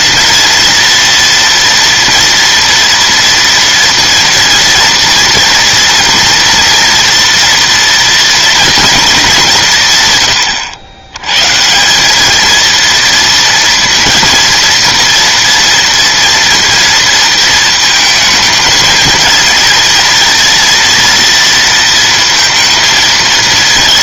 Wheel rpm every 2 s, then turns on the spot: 230, 230, 230, 230, 230, 100, 230, 230, 230, 220, 230, 230.
none